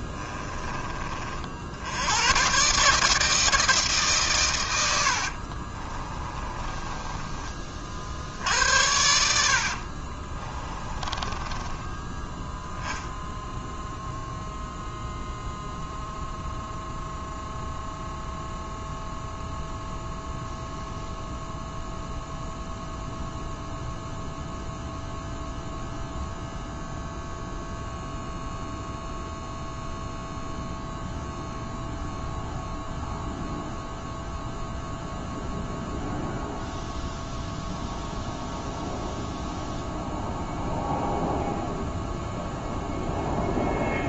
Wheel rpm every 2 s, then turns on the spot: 30, 150, 80, 20, 80, 20, 0, 0, 0, 0, 0, 0, 0, 0, 0, 0, 0, 0, 0, 0, 0, 0.
4-8 10-12